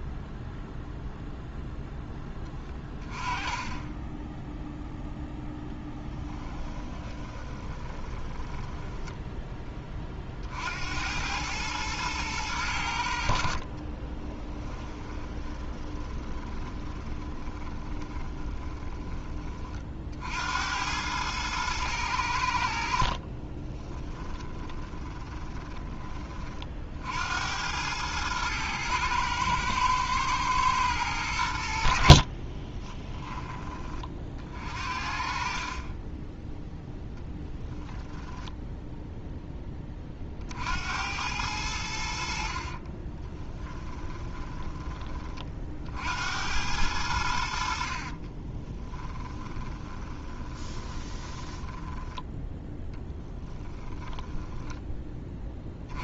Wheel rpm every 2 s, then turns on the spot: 0, 20, 0, 20, 10, 80, 90, 20, 20, 20, 90, 60, 20, 60, 110, 100, 20, 50, 0, 0, 80, 30, 20, 90, 20, 20, 10, 10.
6-10 14-18 22-26 32-34 42-44 48-52